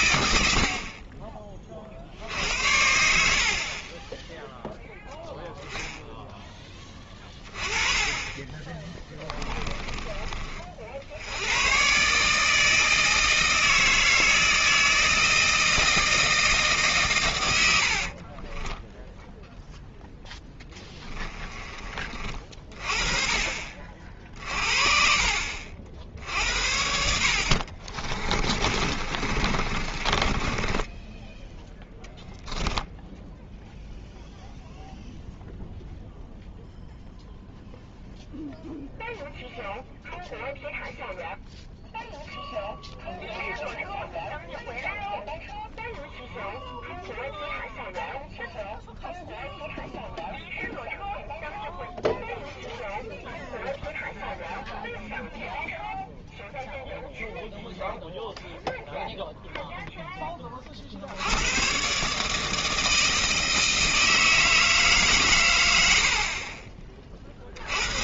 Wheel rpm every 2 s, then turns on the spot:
50, 60, 0, 20, 20, 50, 160, 160, 160, 30, 10, 30, 50, 60, 40, 20, 0, 0, 0, 0, 0, 0, 0, 0, 0, 0, 0, 0, 0, 0, 60, 160, 150, 40.
6-8 18-22 28-32